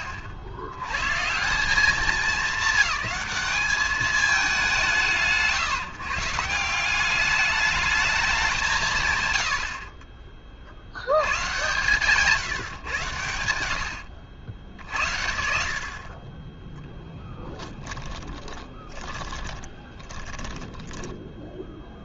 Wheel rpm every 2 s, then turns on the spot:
70, 200, 170, 190, 140, 100, 130, 70, 10, 20, 10.
16-22